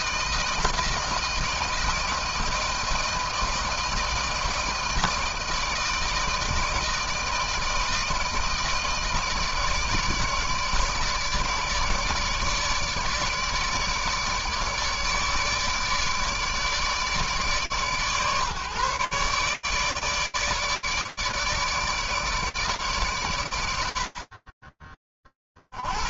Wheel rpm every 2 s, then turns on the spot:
160, 160, 160, 160, 160, 150, 150, 150, 150, 140, 150, 150, 20.
none